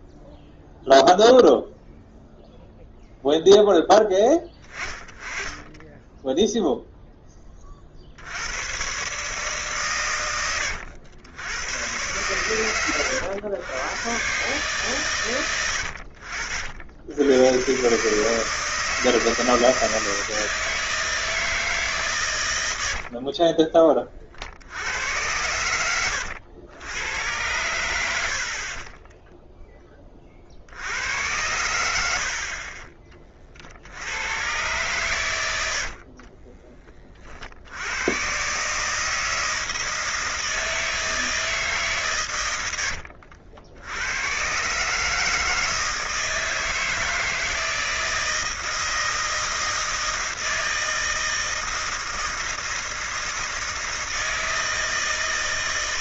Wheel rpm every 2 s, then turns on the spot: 0, 0, 10, 0, 100, 100, 110, 140, 70, 150, 160, 90, 70, 100, 40, 70, 40, 120, 20, 130, 160, 100, 130, 160, 160, 160, 160, 160.
none